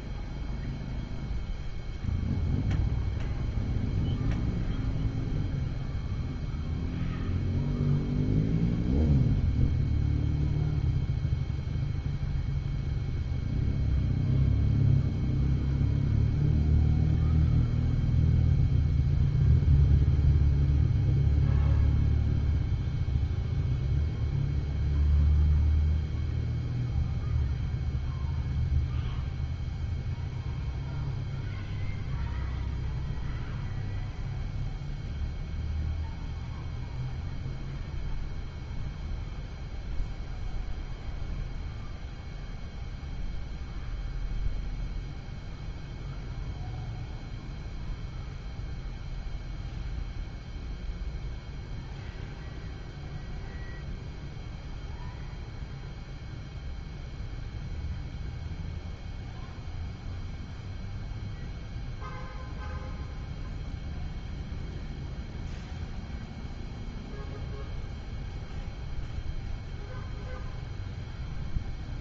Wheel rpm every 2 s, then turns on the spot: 0, 0, 0, 0, 0, 0, 0, 0, 0, 0, 0, 0, 0, 0, 0, 0, 0, 0, 0, 0, 0, 0, 0, 0, 0, 0, 0, 0, 0, 0, 0, 0, 0, 0, 0, 0.
none